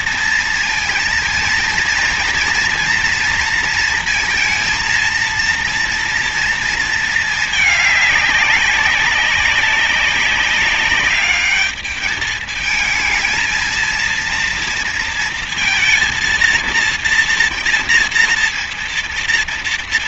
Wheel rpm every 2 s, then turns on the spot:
230, 230, 230, 230, 200, 190, 220, 230, 230, 230.
none